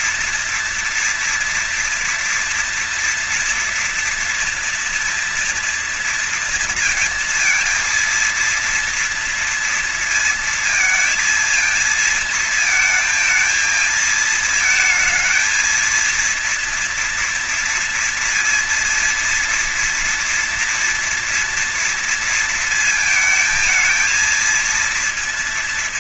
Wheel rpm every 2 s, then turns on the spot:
230, 240, 230, 230, 230, 230, 220, 230, 230, 230, 230, 230, 230.
none